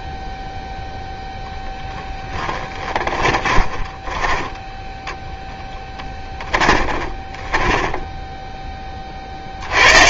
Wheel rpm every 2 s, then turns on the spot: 0, 10, 10, 20, 10.
2-8